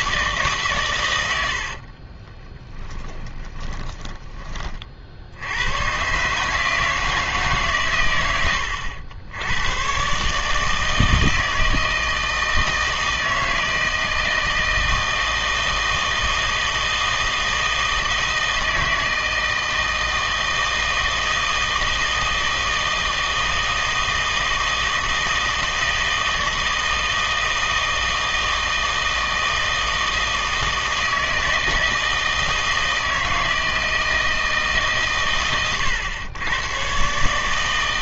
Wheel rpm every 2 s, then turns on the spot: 130, 20, 40, 160, 90, 160, 160, 160, 160, 160, 160, 160, 160, 160, 160, 160, 160, 150, 120.
2-4